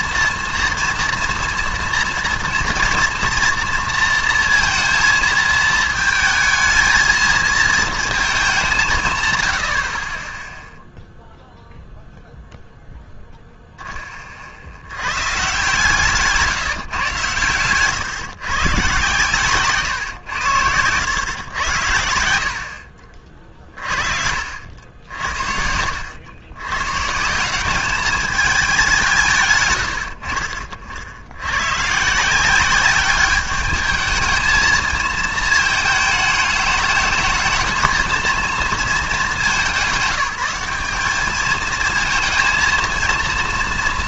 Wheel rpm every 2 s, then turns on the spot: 230, 230, 230, 220, 180, 0, 0, 70, 150, 120, 90, 60, 70, 100, 200, 60, 190, 220, 210, 220, 190, 230.
none